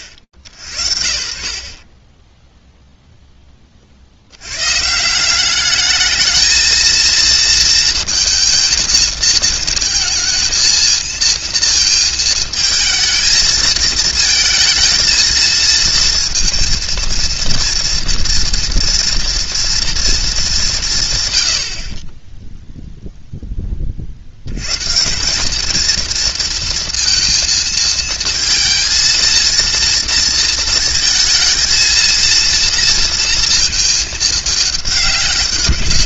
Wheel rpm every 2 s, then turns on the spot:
70, 0, 160, 230, 220, 230, 220, 230, 230, 230, 150, 0, 190, 230, 230, 230, 230, 200.
none